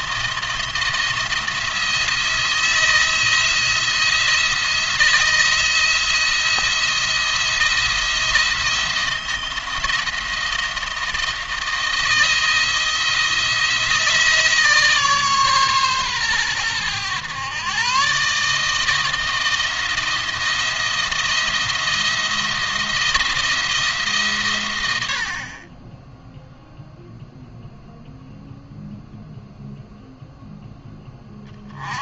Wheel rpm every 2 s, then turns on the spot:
170, 160, 170, 170, 170, 170, 160, 160, 110, 150, 170, 170, 110, 0, 0, 10.
none